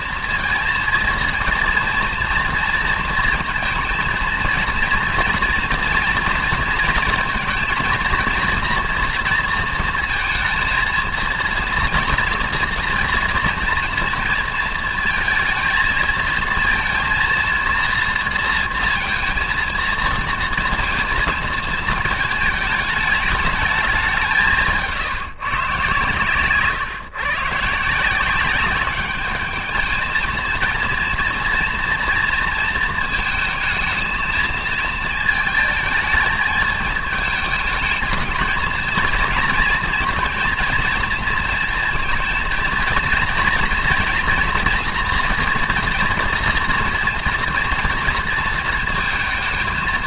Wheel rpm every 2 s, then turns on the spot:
230, 230, 230, 230, 230, 230, 230, 230, 230, 230, 230, 220, 180, 130, 190, 230, 230, 230, 220, 220, 230, 230, 230, 240, 230.
none